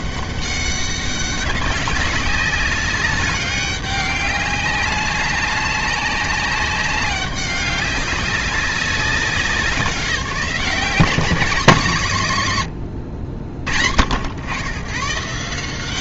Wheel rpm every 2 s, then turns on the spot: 190, 200, 200, 190, 190, 190, 130, 100.
none